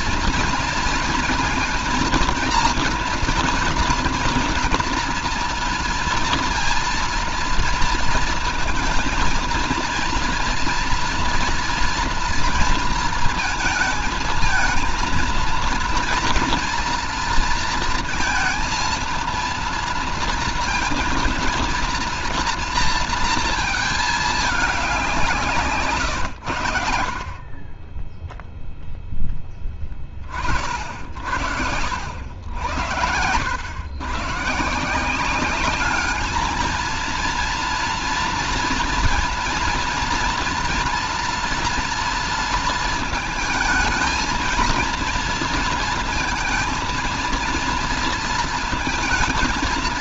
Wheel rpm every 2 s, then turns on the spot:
230, 230, 230, 230, 230, 230, 230, 220, 240, 230, 230, 230, 210, 100, 0, 40, 80, 130, 220, 230, 230, 230, 230, 230, 230.
none